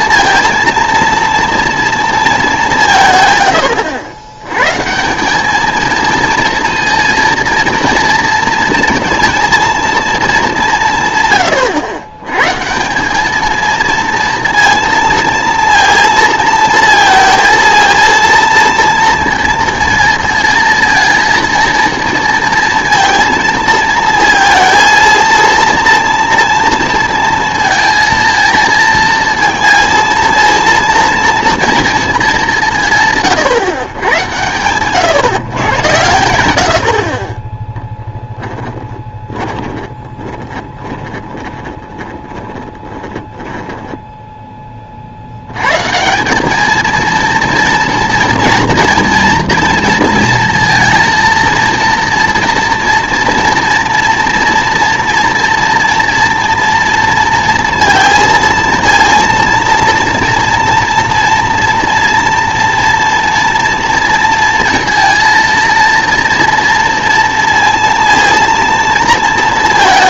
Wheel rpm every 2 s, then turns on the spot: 230, 180, 140, 230, 230, 180, 160, 230, 230, 230, 230, 230, 230, 230, 230, 230, 170, 120, 80, 10, 20, 20, 30, 220, 230, 230, 230, 230, 230, 230, 230, 230, 230, 230, 230.
38-44